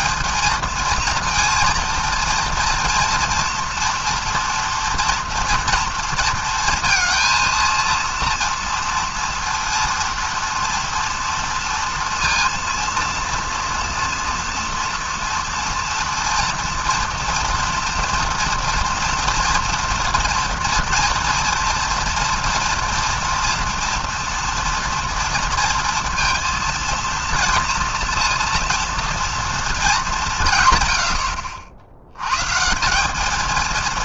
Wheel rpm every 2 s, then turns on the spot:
230, 230, 230, 230, 230, 230, 230, 240, 230, 230, 230, 240, 230, 230, 230, 110, 170.
none